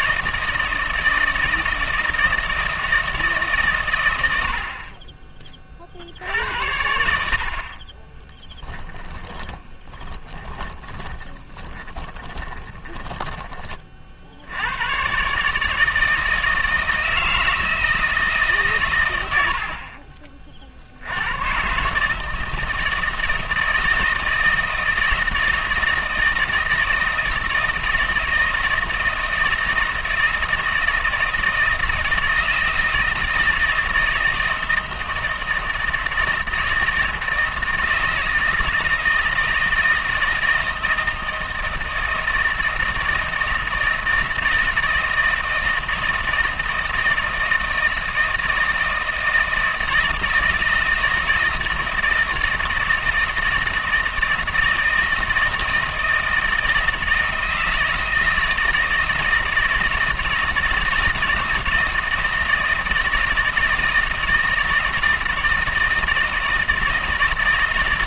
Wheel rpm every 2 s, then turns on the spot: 160, 160, 70, 80, 30, 20, 20, 90, 160, 140, 50, 160, 160, 160, 160, 160, 160, 160, 160, 160, 160, 160, 160, 160, 160, 160, 160, 160, 160, 160, 160, 160, 160, 160.
8-14